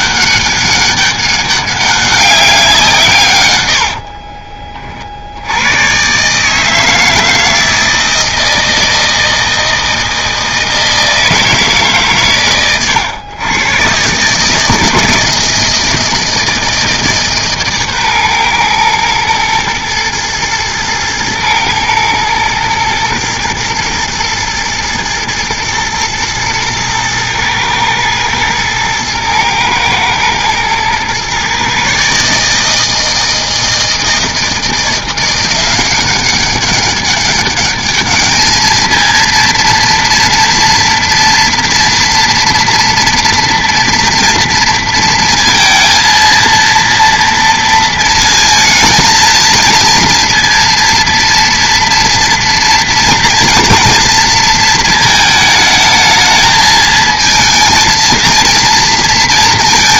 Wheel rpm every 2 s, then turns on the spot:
200, 190, 30, 150, 160, 160, 130, 150, 160, 120, 110, 120, 110, 110, 110, 110, 150, 160, 200, 220, 230, 240, 230, 230, 230, 230, 230, 230, 220, 230.
none